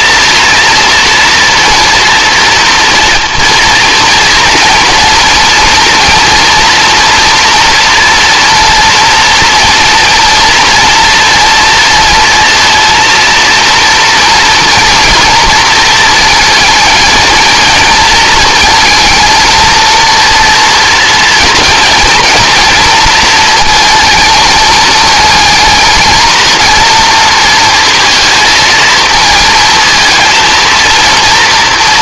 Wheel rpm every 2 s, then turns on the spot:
230, 230, 230, 240, 230, 230, 230, 230, 220, 220, 230, 230, 220, 230, 220, 230.
none